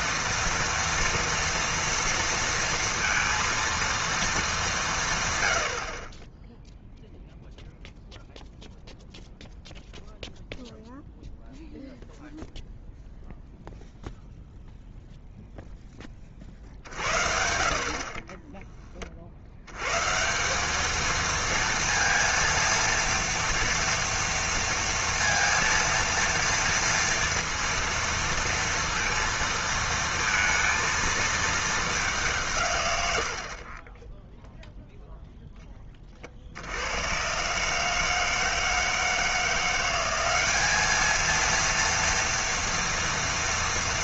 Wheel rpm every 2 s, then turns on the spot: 230, 230, 200, 0, 0, 0, 0, 0, 50, 20, 200, 230, 230, 230, 230, 230, 140, 0, 80, 160, 200, 230.
none